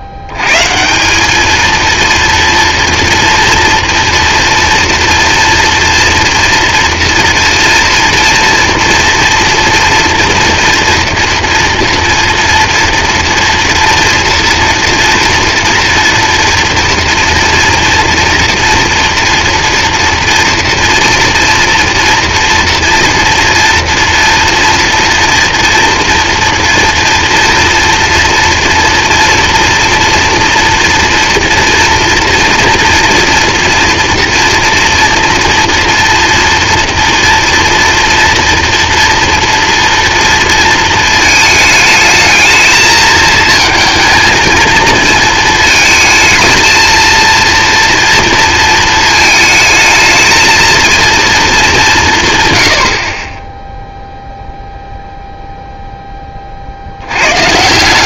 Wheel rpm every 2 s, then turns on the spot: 110, 230, 240, 240, 240, 240, 230, 230, 230, 240, 230, 240, 230, 230, 230, 240, 230, 230, 230, 230, 230, 220, 220, 220, 220, 220, 130, 0, 50.
none